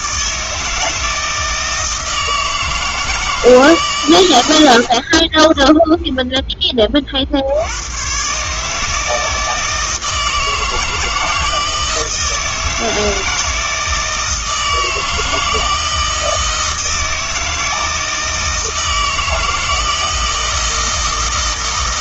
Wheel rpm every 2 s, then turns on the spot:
160, 160, 80, 30, 150, 160, 160, 160, 160, 160, 160.
4-6